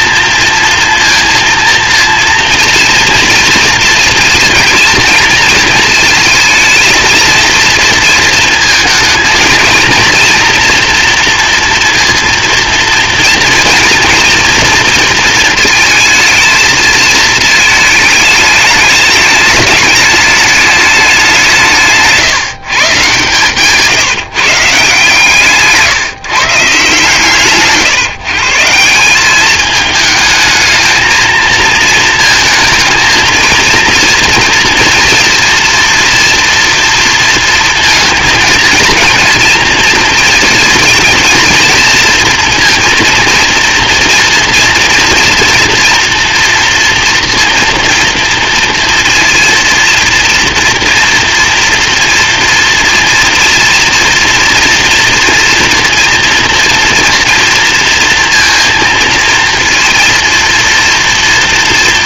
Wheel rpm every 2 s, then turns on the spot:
230, 230, 230, 230, 230, 230, 230, 230, 220, 210, 190, 140, 150, 150, 190, 220, 230, 240, 230, 230, 230, 230, 230, 230, 230, 230, 230, 240, 230, 230, 230.
none